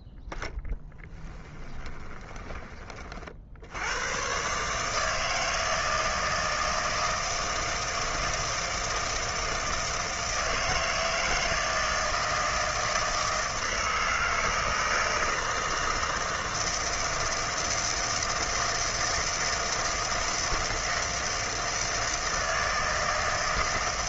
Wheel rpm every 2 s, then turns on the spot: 0, 20, 140, 160, 160, 160, 160, 160, 160, 160, 160, 160.
none